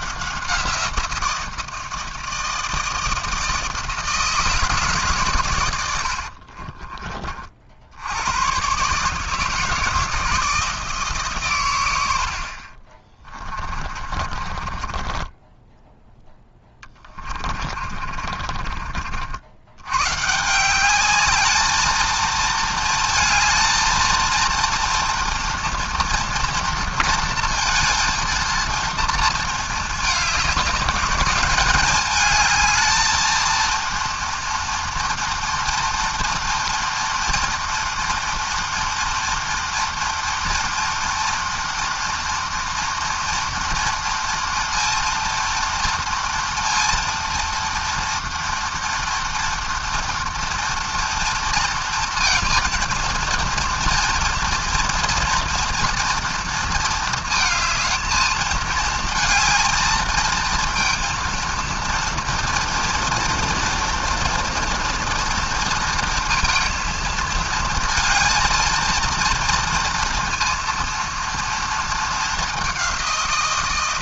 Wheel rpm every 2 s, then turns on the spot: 170, 160, 150, 40, 130, 160, 40, 40, 10, 50, 190, 230, 230, 230, 230, 210, 220, 230, 230, 230, 230, 230, 230, 240, 240, 230, 230, 230, 230, 220, 230, 230, 230, 220, 230, 230, 200.
6-8 14-20